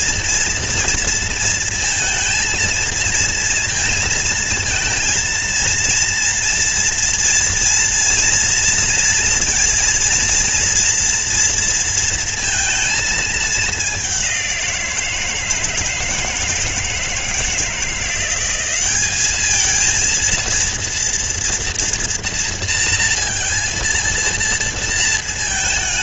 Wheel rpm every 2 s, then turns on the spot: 230, 230, 230, 230, 230, 230, 230, 200, 160, 180, 220, 230, 230.
none